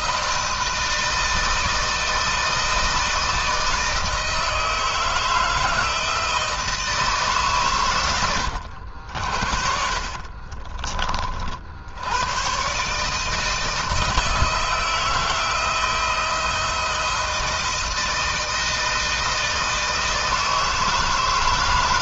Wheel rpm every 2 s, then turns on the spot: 160, 160, 160, 160, 90, 40, 110, 160, 160, 170, 160.
10-12